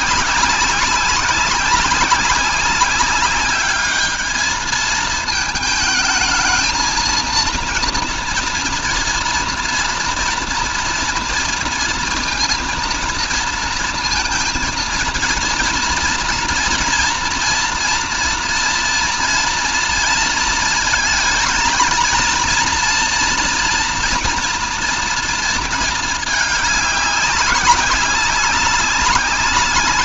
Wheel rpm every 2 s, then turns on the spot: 190, 190, 220, 220, 230, 230, 230, 230, 230, 230, 220, 230, 240, 210, 200.
none